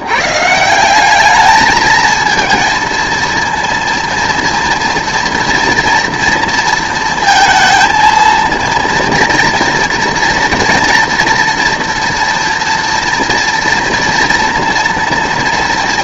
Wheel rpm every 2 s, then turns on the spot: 180, 230, 230, 230, 230, 230, 230, 230.
none